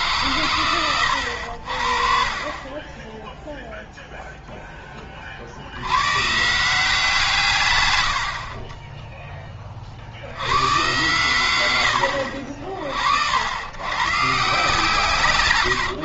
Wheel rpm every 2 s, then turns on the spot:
120, 30, 0, 150, 30, 100, 60, 150.
none